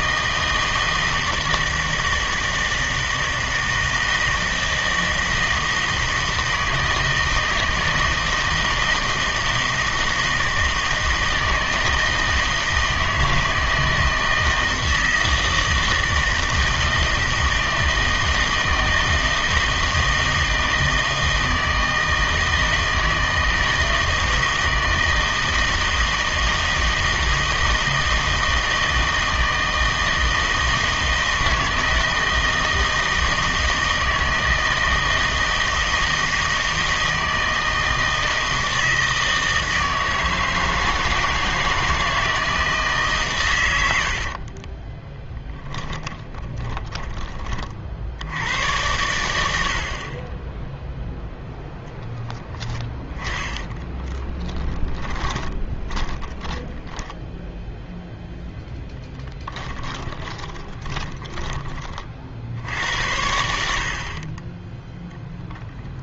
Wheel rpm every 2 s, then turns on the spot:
160, 160, 160, 160, 160, 160, 160, 160, 160, 160, 160, 160, 160, 160, 160, 160, 160, 160, 160, 160, 160, 160, 40, 20, 100, 10, 10, 10, 10, 0, 20, 70, 20.
44-48 52-58 60-62